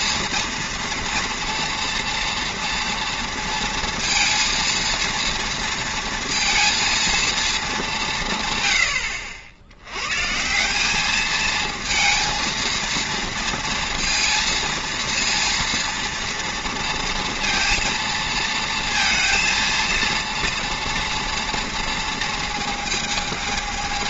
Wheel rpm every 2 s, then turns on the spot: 230, 240, 230, 230, 110, 180, 230, 230, 230, 230, 230, 220.
none